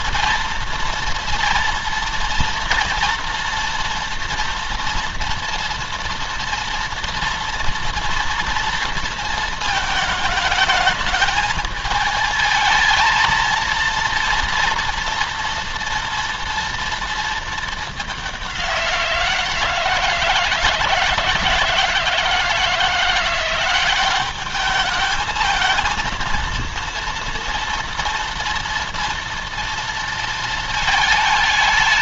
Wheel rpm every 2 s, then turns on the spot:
230, 230, 230, 230, 230, 220, 220, 230, 230, 190, 160, 160, 200, 230, 230, 220.
none